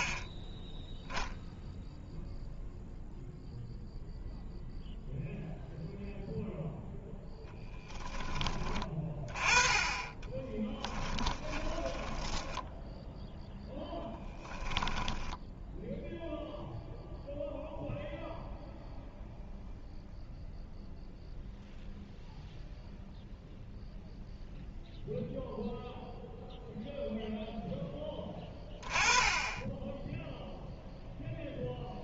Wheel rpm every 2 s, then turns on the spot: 10, 0, 0, 0, 20, 20, 0, 10, 0, 0, 0, 0, 0, 0, 20, 0.
10-12 14-16